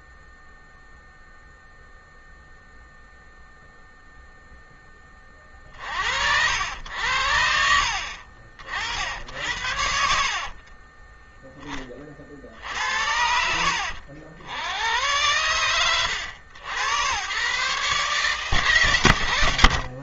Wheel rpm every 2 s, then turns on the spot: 0, 0, 0, 70, 60, 40, 50, 80, 100, 140.
none